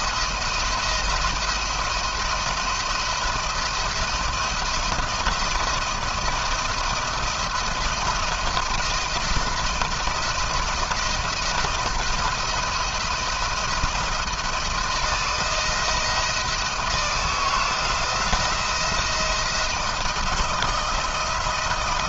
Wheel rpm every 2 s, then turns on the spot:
170, 170, 170, 170, 170, 170, 170, 170, 170, 170, 170.
none